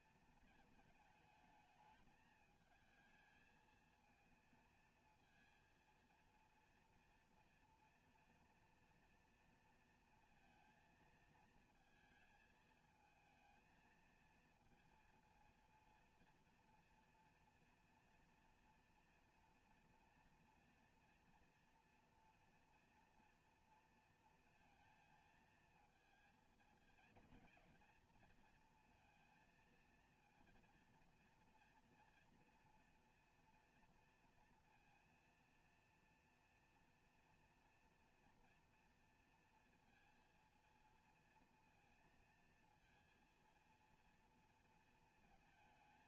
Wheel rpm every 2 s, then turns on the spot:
230, 220, 230, 230, 230, 230, 220, 230, 230, 240, 230, 230, 220, 230, 230, 230, 240, 230, 230, 230, 230, 230, 230.
none